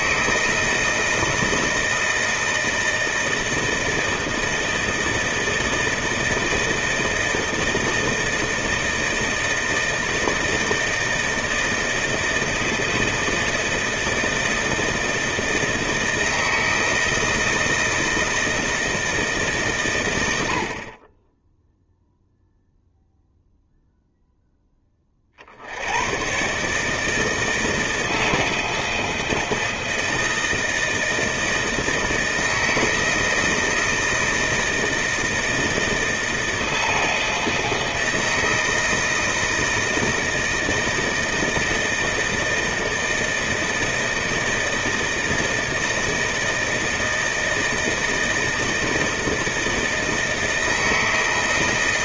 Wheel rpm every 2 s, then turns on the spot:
160, 160, 160, 160, 160, 160, 160, 160, 160, 160, 40, 0, 20, 140, 160, 160, 160, 160, 160, 160, 160, 160, 160, 160, 160, 160.
none